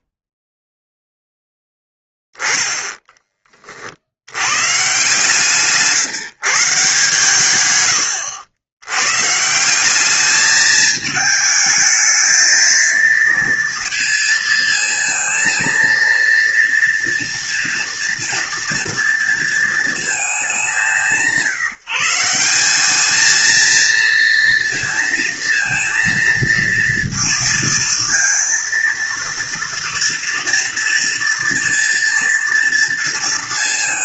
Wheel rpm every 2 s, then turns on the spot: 0, 30, 140, 120, 160, 220, 230, 230, 230, 230, 160, 220, 230, 230, 230, 230, 230.
4-6